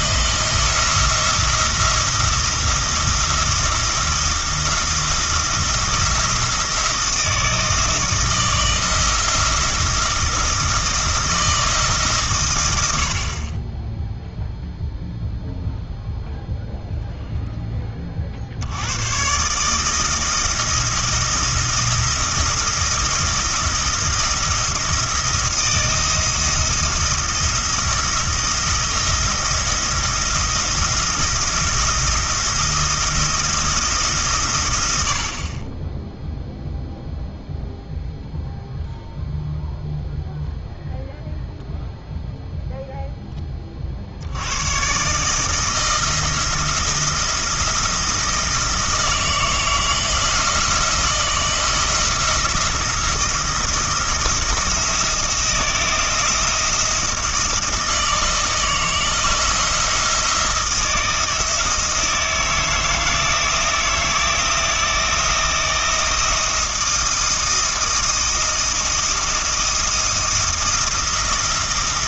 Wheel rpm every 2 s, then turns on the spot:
170, 170, 170, 170, 170, 170, 100, 0, 0, 80, 170, 170, 170, 170, 160, 170, 170, 110, 0, 0, 0, 0, 110, 170, 160, 170, 170, 170, 170, 160, 160, 160, 170, 160, 170, 170.
none